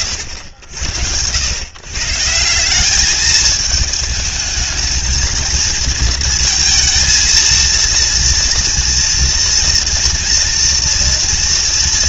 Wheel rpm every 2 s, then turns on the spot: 100, 180, 220, 230, 230, 230.
none